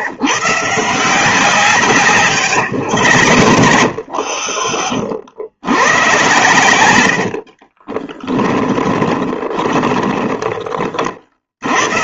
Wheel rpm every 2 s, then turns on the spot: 140, 110, 40, 110, 10, 30.
2-4 8-10